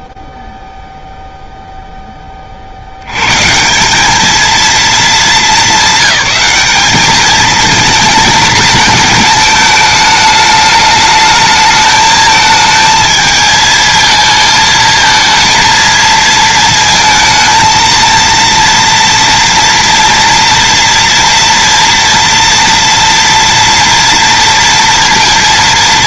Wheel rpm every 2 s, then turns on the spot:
0, 100, 210, 210, 220, 220, 220, 220, 230, 230, 230, 230, 230.
none